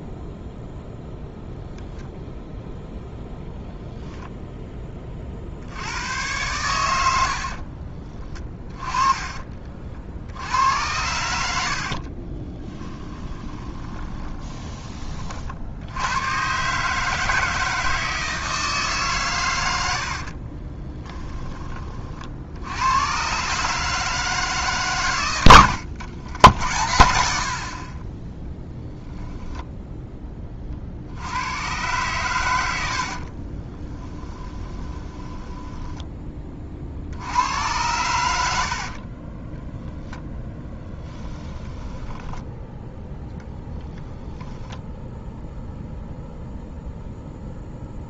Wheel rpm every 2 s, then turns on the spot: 0, 0, 20, 90, 20, 90, 20, 20, 140, 150, 20, 90, 140, 80, 0, 40, 90, 20, 40, 60, 10, 10, 0, 0.
8-10 12-14 20-22 34-36 40-42